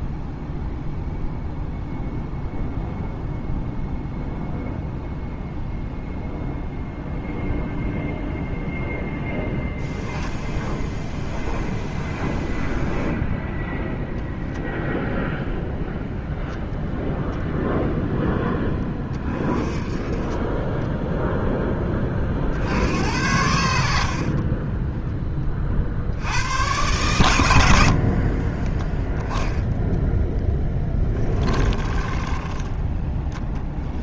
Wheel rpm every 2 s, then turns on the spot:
0, 0, 0, 0, 0, 0, 0, 0, 0, 20, 10, 80, 20, 110, 10, 10, 20.
24-26 28-34